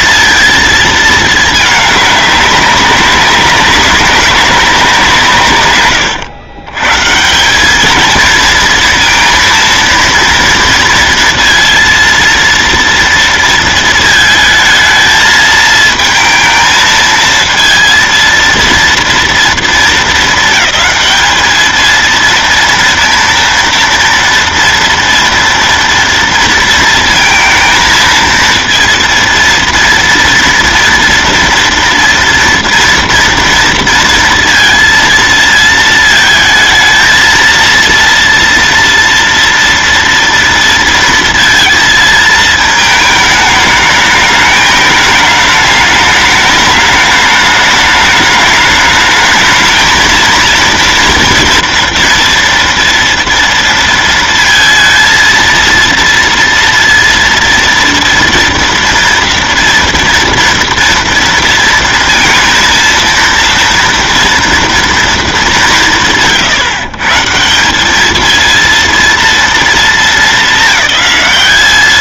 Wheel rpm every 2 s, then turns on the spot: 230, 200, 190, 100, 230, 230, 230, 220, 220, 230, 220, 230, 240, 230, 230, 230, 240, 230, 220, 230, 230, 220, 210, 210, 210, 220, 230, 230, 230, 230, 230, 230, 240, 160, 220, 220.
none